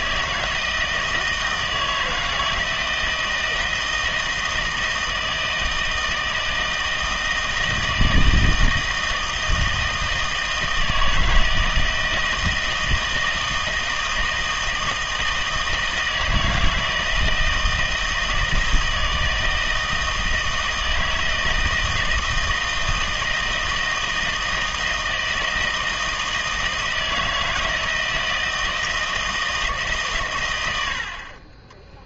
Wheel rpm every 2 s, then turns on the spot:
160, 160, 160, 160, 160, 160, 160, 160, 160, 160, 160, 160, 160, 160, 160, 90.
none